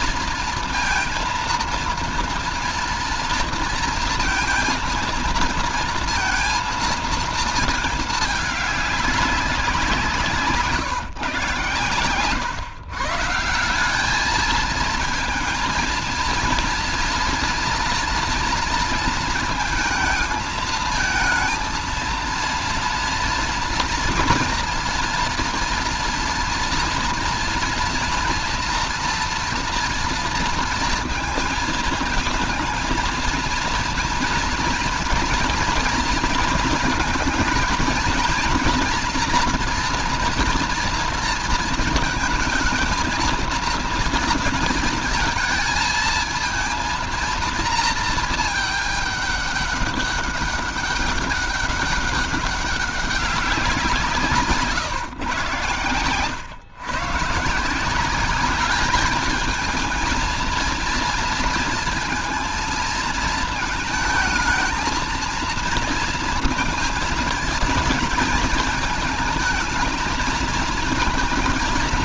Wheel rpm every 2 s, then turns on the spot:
230, 230, 230, 230, 210, 150, 120, 220, 230, 230, 220, 230, 230, 230, 230, 230, 220, 230, 230, 230, 230, 220, 230, 230, 210, 200, 200, 150, 130, 200, 230, 230, 230, 230, 220, 220.
none